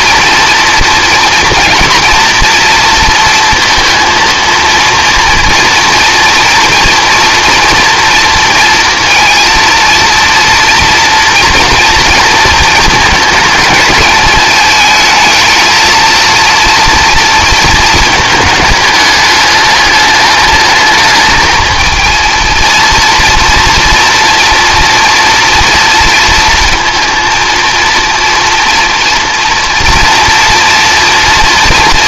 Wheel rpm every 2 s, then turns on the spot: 230, 230, 230, 230, 230, 230, 220, 220, 230, 210, 210, 230, 230, 230, 230, 240.
none